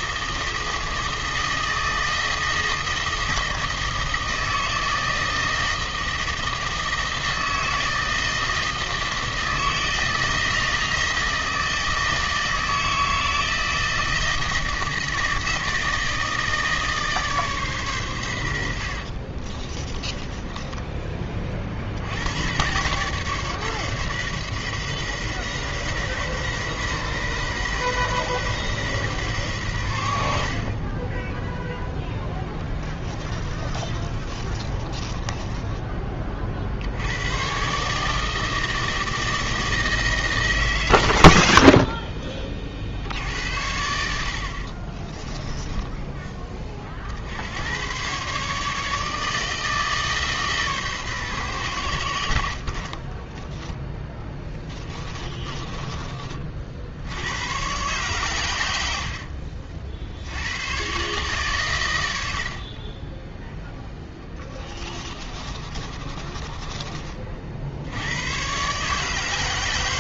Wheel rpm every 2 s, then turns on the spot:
160, 160, 160, 160, 160, 160, 160, 160, 160, 90, 20, 100, 130, 130, 130, 50, 10, 30, 40, 160, 150, 40, 60, 30, 140, 140, 60, 10, 40, 100, 90, 60, 20, 20, 110.
20-22 32-36 44-46 52-56 64-68